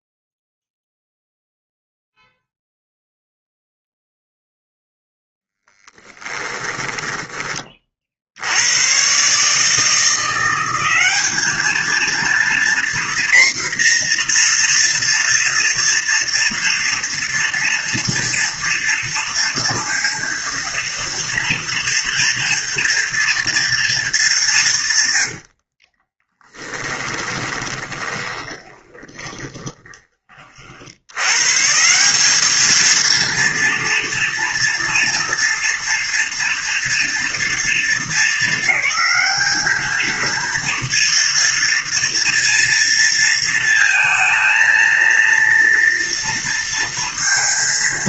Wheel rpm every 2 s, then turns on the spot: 0, 0, 0, 10, 100, 190, 240, 230, 240, 230, 230, 230, 150, 20, 30, 70, 220, 230, 230, 210, 230, 230, 230, 230.
6-8 24-30